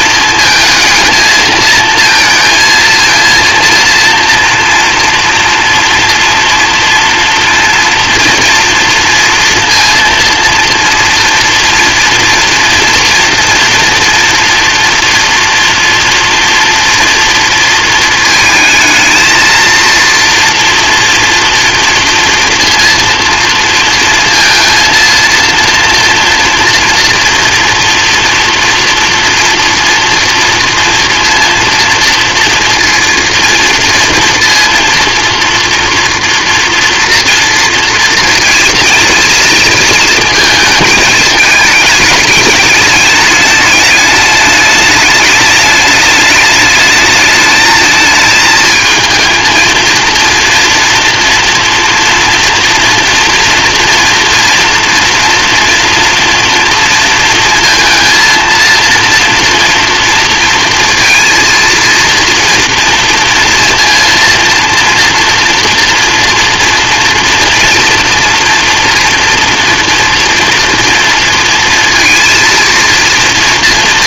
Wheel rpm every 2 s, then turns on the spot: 230, 230, 230, 230, 240, 230, 230, 230, 240, 220, 230, 230, 230, 230, 230, 230, 230, 230, 230, 230, 230, 210, 210, 210, 220, 230, 230, 240, 230, 230, 230, 230, 230, 230, 230, 230, 230.
none